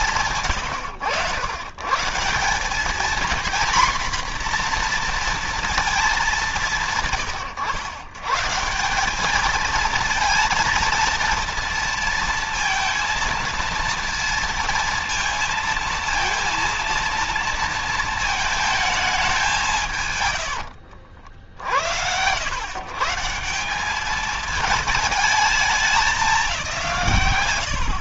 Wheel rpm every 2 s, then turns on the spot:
120, 180, 240, 190, 140, 230, 230, 230, 230, 220, 120, 100, 220, 190.
20-22